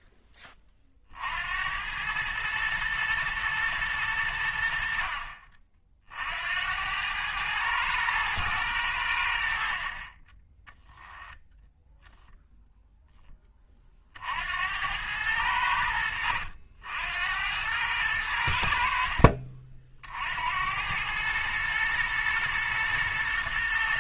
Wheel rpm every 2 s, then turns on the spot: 40, 110, 60, 90, 100, 10, 0, 90, 80, 60, 90, 120.
none